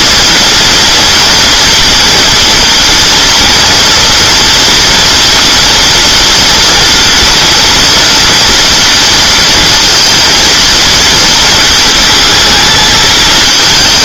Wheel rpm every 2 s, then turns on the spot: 230, 230, 230, 230, 240, 230, 220.
none